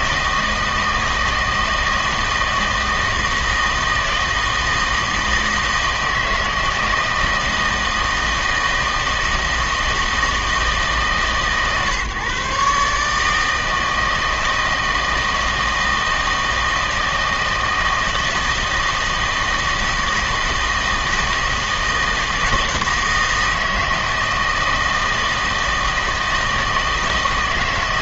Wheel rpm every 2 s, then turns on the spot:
160, 160, 160, 160, 160, 160, 140, 160, 160, 160, 160, 160, 160, 160.
none